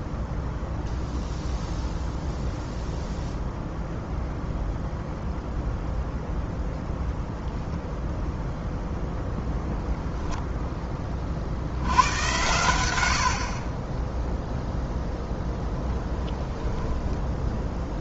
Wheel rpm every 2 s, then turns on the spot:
0, 0, 0, 0, 0, 10, 90, 0, 10.
16-18